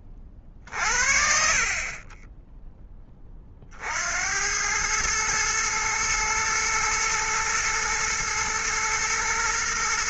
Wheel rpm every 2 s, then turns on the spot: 50, 10, 100, 120, 120.
none